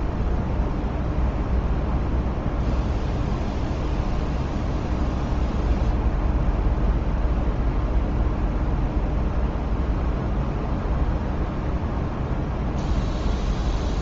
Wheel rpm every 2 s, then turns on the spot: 0, 0, 0, 0, 0, 0, 0.
none